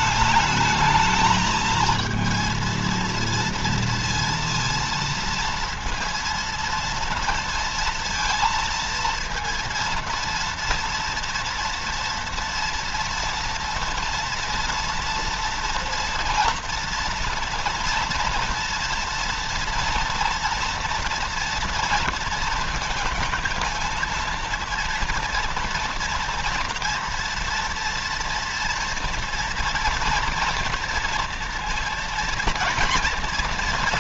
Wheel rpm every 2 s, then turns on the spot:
220, 230, 230, 230, 230, 230, 230, 230, 230, 230, 240, 230, 230, 230, 230, 240, 240.
none